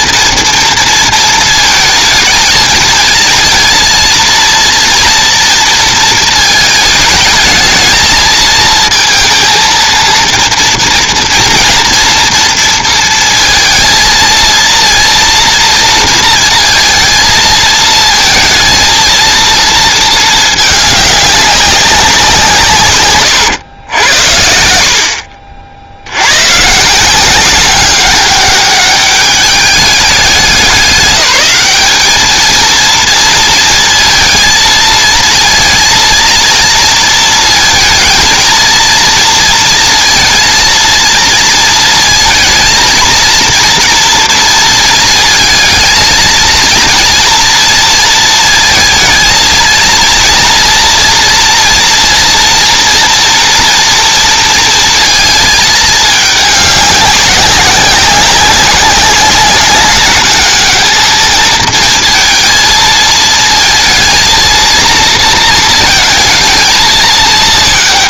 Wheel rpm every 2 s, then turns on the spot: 220, 220, 230, 220, 220, 230, 230, 230, 220, 230, 200, 120, 50, 180, 200, 200, 230, 230, 230, 230, 220, 230, 230, 230, 220, 230, 230, 220, 200, 200, 220, 230, 230, 210.
none